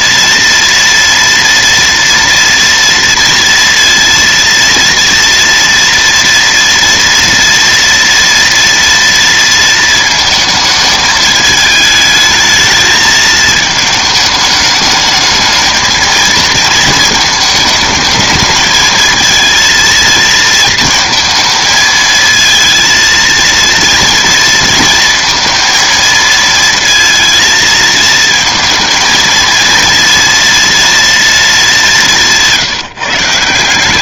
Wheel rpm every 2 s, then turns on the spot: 230, 230, 230, 230, 230, 220, 220, 220, 220, 220, 230, 230, 230, 230, 230, 230, 180.
none